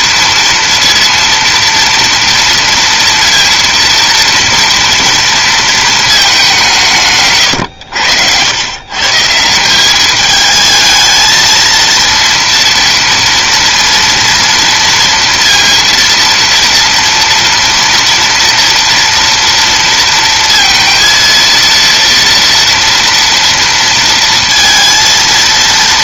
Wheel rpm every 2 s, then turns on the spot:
230, 230, 230, 170, 120, 220, 230, 230, 230, 230, 230, 230, 230.
none